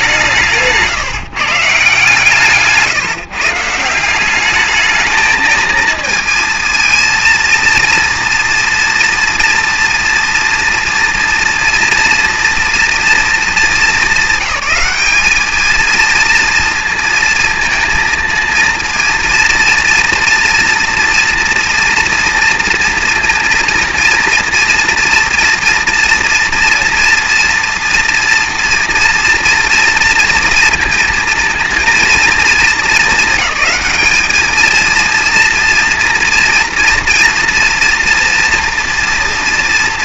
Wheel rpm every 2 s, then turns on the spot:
170, 140, 200, 230, 240, 240, 230, 200, 230, 220, 230, 230, 230, 230, 230, 230, 220, 220, 230, 240.
2-4